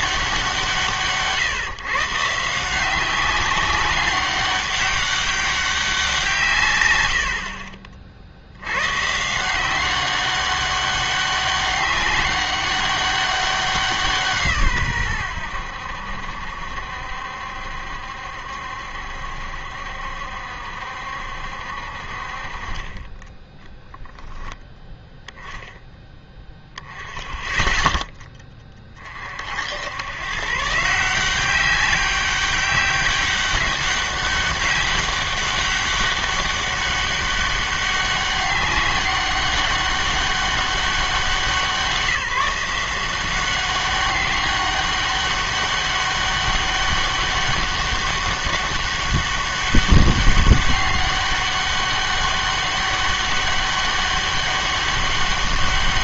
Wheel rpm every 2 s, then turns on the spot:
170, 170, 200, 140, 110, 200, 200, 140, 70, 70, 70, 40, 10, 10, 10, 140, 200, 200, 200, 200, 190, 170, 200, 200, 200, 200, 200, 200.
none